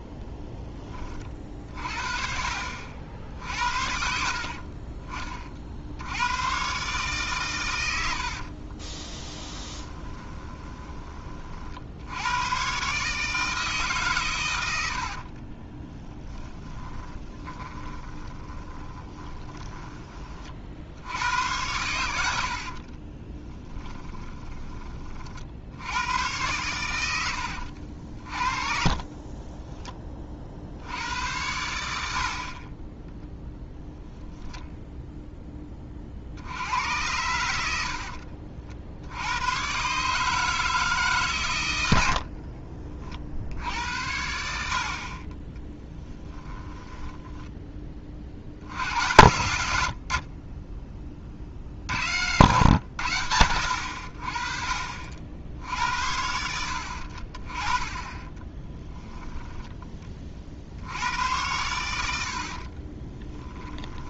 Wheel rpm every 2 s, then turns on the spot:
10, 50, 40, 130, 30, 20, 140, 80, 20, 20, 60, 40, 30, 100, 40, 60, 20, 0, 90, 50, 160, 50, 60, 10, 80, 30, 100, 40, 70, 10, 70, 30.
8-12 16-20 22-24 28-30 58-60 62-64